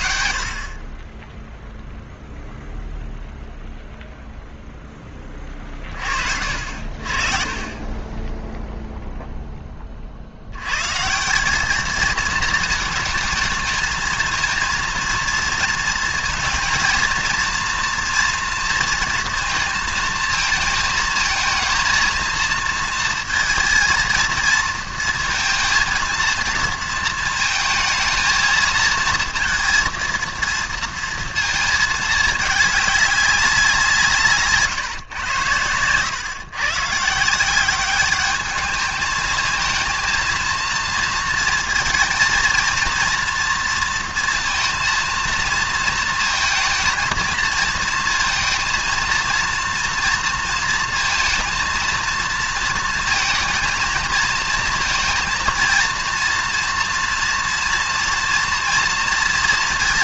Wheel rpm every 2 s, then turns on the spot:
50, 0, 0, 60, 0, 100, 220, 230, 230, 230, 220, 230, 230, 230, 230, 230, 210, 150, 130, 210, 230, 230, 230, 230, 230, 230, 230, 230, 230, 230.
none